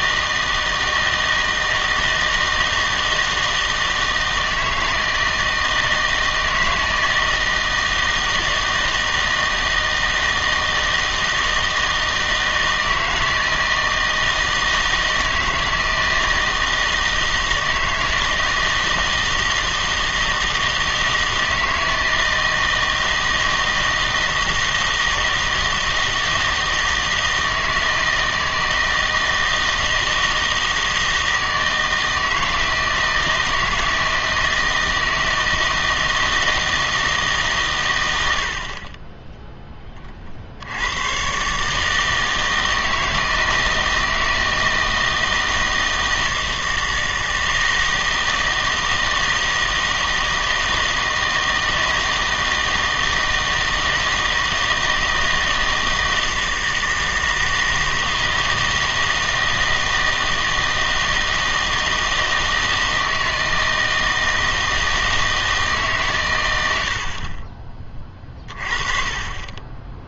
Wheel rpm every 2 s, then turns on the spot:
160, 160, 160, 160, 160, 160, 160, 160, 160, 160, 160, 160, 160, 160, 160, 160, 160, 160, 160, 60, 80, 160, 160, 160, 160, 160, 160, 160, 160, 160, 160, 160, 160, 90, 30.
none